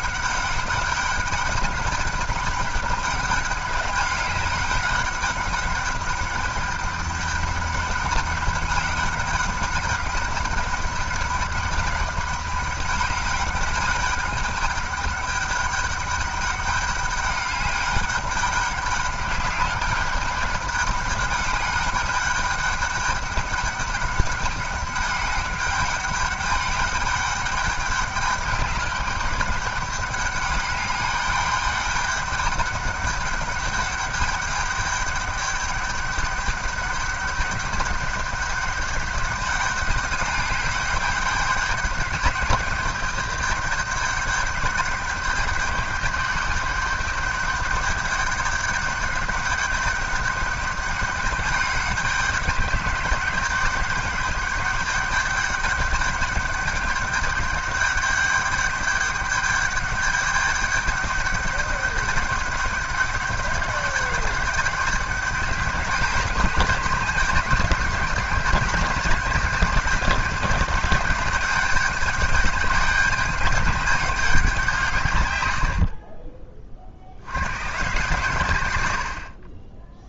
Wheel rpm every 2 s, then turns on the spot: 200, 200, 200, 200, 200, 200, 200, 210, 200, 200, 210, 210, 200, 200, 210, 200, 200, 210, 200, 200, 200, 210, 200, 200, 200, 200, 200, 210, 200, 200, 200, 200, 200, 210, 200, 200, 200, 160, 50, 90.
none